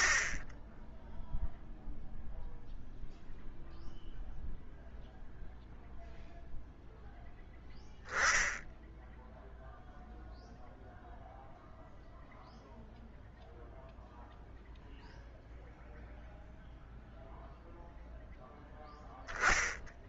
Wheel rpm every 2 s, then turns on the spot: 10, 0, 0, 0, 10, 0, 0, 0, 0, 0.
none